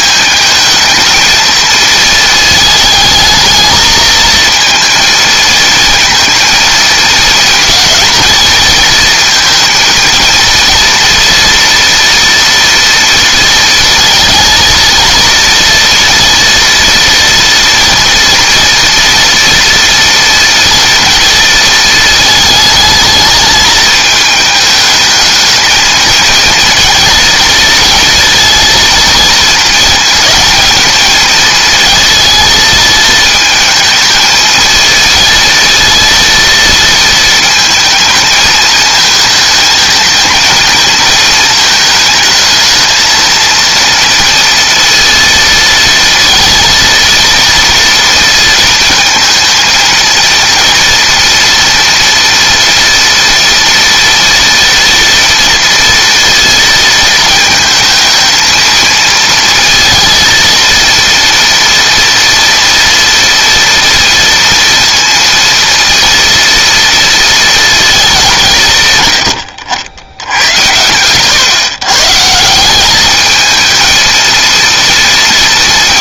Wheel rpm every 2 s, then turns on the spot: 220, 220, 220, 230, 230, 220, 230, 230, 230, 240, 230, 220, 210, 220, 230, 220, 220, 220, 230, 220, 220, 220, 230, 230, 230, 230, 230, 230, 230, 220, 230, 230, 230, 230, 140, 120, 190, 230.
none